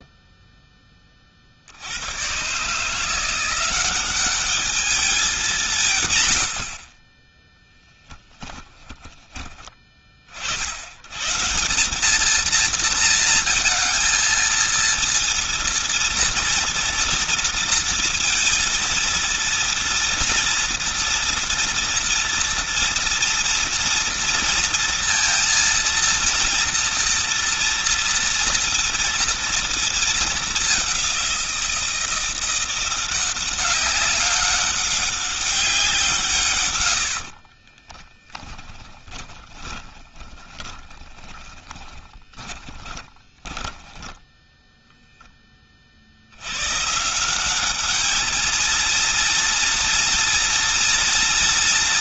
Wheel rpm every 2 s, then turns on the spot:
10, 130, 200, 90, 10, 60, 220, 230, 230, 230, 230, 230, 230, 230, 230, 210, 170, 200, 120, 10, 20, 20, 10, 100, 220, 230.
36-44